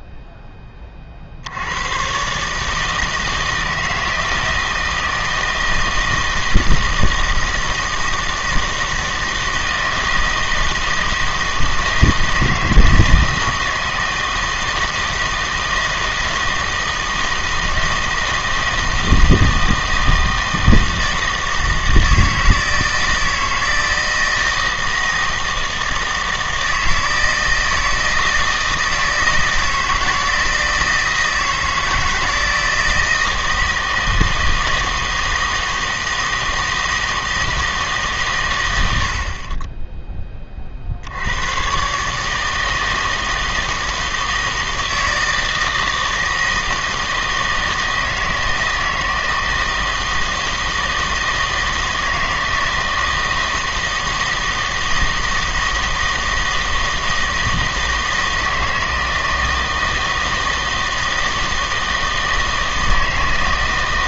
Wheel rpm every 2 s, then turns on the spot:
20, 150, 160, 160, 160, 160, 160, 160, 160, 160, 160, 160, 160, 160, 160, 160, 160, 170, 160, 140, 40, 160, 160, 160, 160, 160, 160, 160, 160, 160, 160, 160.
none